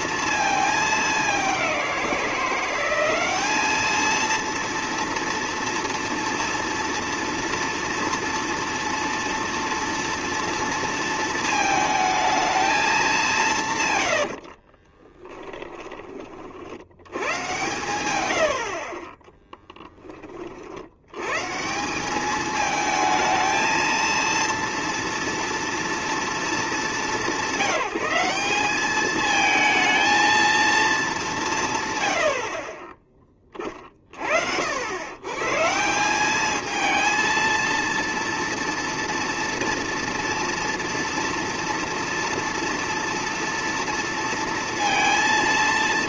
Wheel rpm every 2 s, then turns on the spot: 220, 180, 230, 230, 230, 230, 220, 80, 50, 80, 40, 210, 230, 220, 200, 230, 70, 70, 210, 230, 230, 230, 230.
14-16 18-20